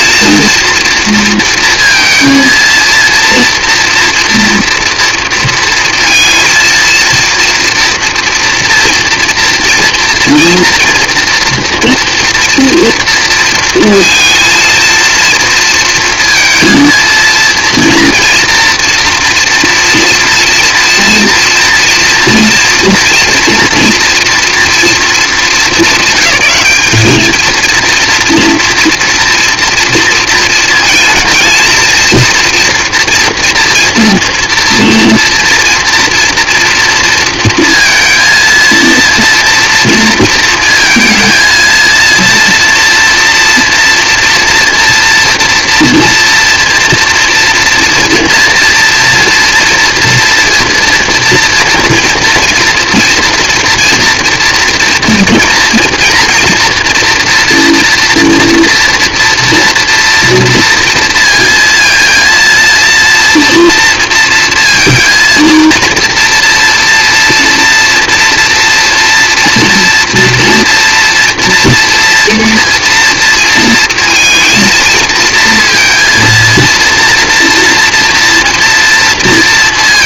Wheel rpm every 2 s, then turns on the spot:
230, 230, 230, 230, 240, 230, 230, 230, 230, 230, 230, 230, 230, 200, 230, 230, 230, 230, 230, 230, 230, 230, 230, 230, 230, 230, 230, 230, 230, 230, 230, 230, 230, 230, 230, 230, 230, 230, 230, 230.
none